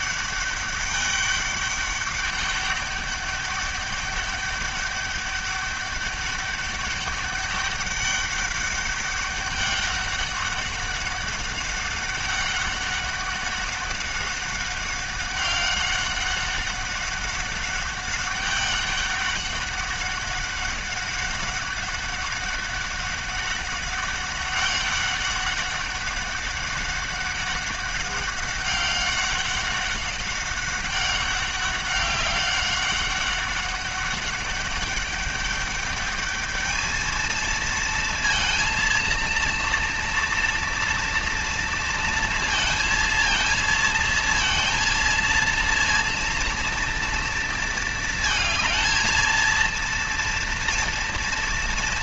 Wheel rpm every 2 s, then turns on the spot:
200, 200, 200, 200, 200, 200, 200, 200, 200, 200, 190, 190, 190, 200, 200, 190, 200, 200, 210, 230, 230, 230, 230, 230, 220, 230.
none